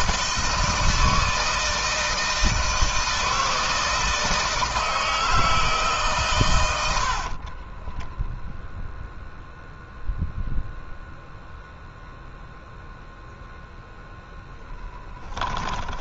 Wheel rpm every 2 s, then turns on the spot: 160, 160, 160, 80, 0, 0, 0, 10.
6-8 14-16